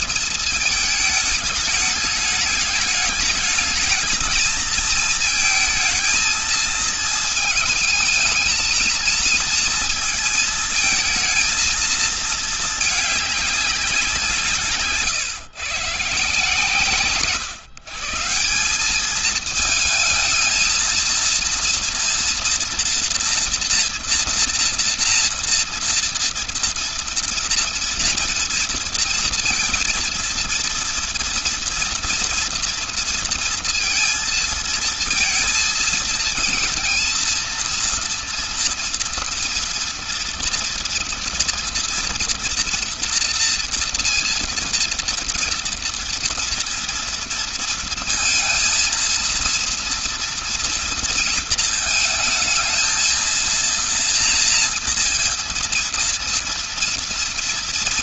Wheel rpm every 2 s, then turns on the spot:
220, 210, 220, 220, 220, 230, 220, 170, 140, 160, 220, 230, 230, 230, 230, 230, 230, 230, 230, 230, 230, 230, 230, 230, 230, 230, 220, 230, 230.
none